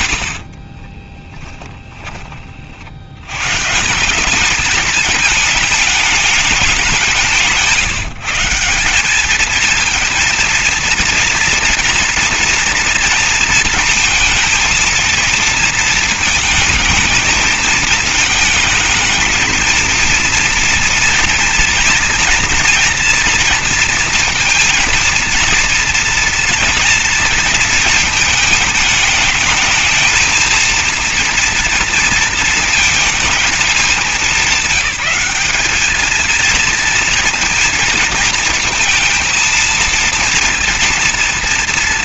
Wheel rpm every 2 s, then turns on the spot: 30, 60, 220, 200, 190, 240, 230, 230, 220, 220, 230, 230, 230, 230, 220, 230, 220, 200, 230, 230, 230.
0-2